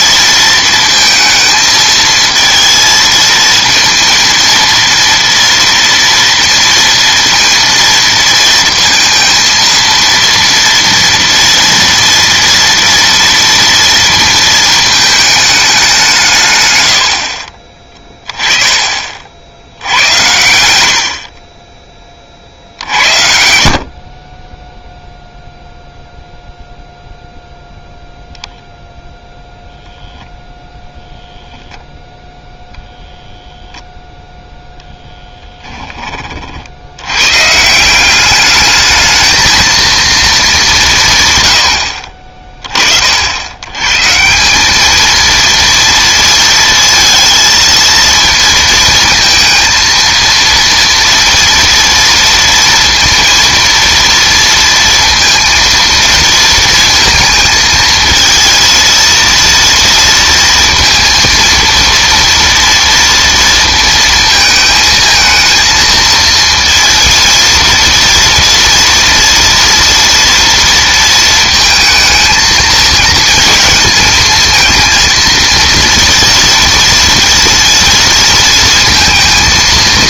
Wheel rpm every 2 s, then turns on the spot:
230, 230, 230, 230, 230, 230, 240, 220, 120, 30, 80, 60, 0, 0, 0, 0, 0, 0, 80, 210, 190, 30, 200, 230, 230, 230, 230, 230, 230, 230, 230, 230, 220, 230, 230, 230, 230, 230, 230, 230.
none